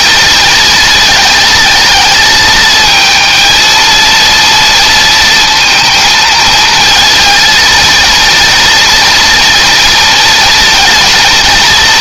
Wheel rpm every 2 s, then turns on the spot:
220, 220, 230, 220, 230, 230.
none